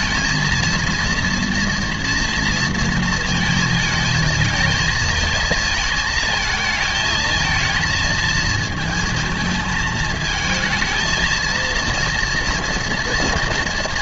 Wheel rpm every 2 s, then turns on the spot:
230, 230, 230, 220, 220, 220, 230.
none